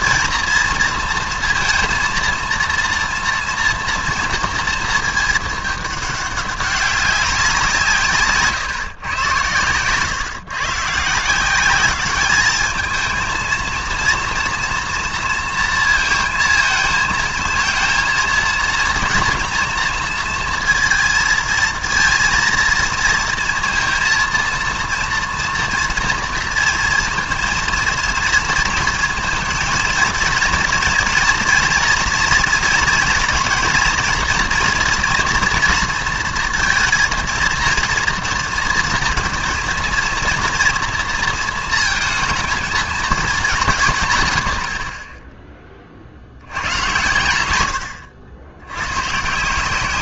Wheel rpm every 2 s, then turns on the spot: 240, 230, 230, 200, 150, 140, 210, 230, 220, 230, 230, 230, 230, 230, 230, 230, 230, 230, 230, 230, 230, 230, 100, 100, 90.
none